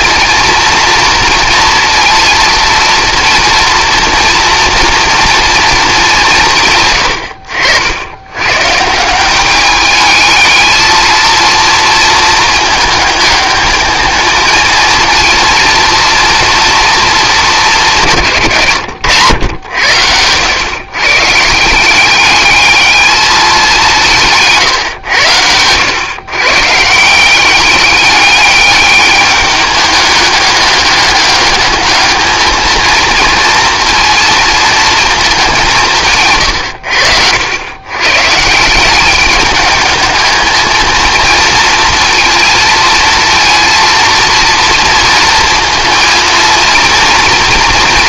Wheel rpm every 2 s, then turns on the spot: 230, 230, 230, 140, 150, 220, 220, 230, 230, 120, 110, 210, 130, 150, 210, 200, 220, 230, 100, 180, 220, 230, 230, 230.
none